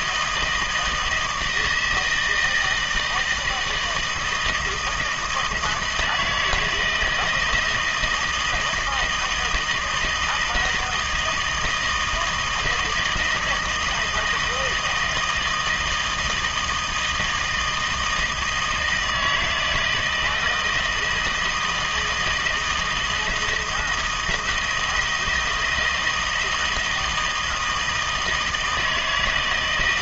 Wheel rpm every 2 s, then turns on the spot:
160, 160, 160, 160, 160, 160, 160, 160, 160, 160, 160, 160, 170, 160, 160.
none